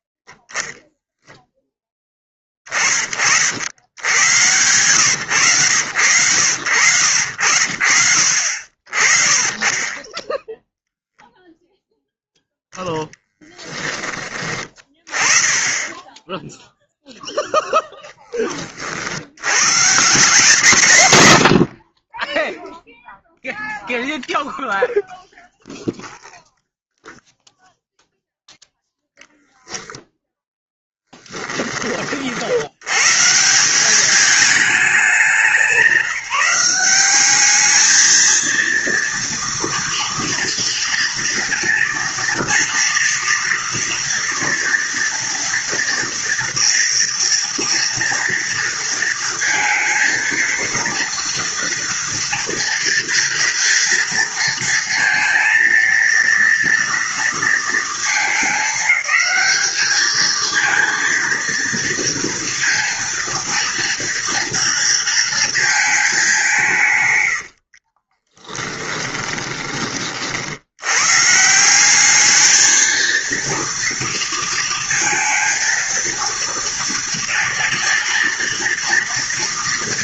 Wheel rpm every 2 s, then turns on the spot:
10, 20, 110, 100, 60, 0, 0, 20, 0, 30, 150, 0, 0, 0, 0, 0, 80, 200, 180, 230, 230, 230, 230, 240, 230, 230, 230, 230, 230, 210, 220, 230, 230, 170, 10, 80, 220, 230, 230, 230.
68-70